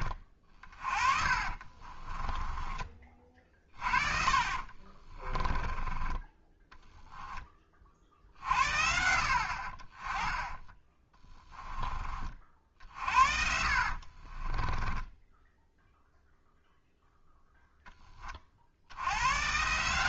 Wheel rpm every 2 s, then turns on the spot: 40, 30, 40, 10, 60, 20, 60, 20, 0, 70.
0-2 4-6 10-16